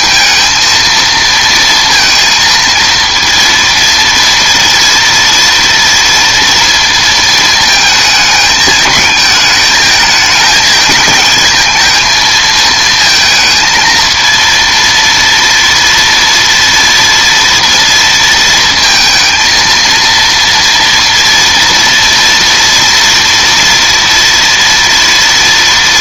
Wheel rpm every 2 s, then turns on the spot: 230, 230, 230, 230, 220, 220, 220, 230, 230, 230, 230, 230, 230.
none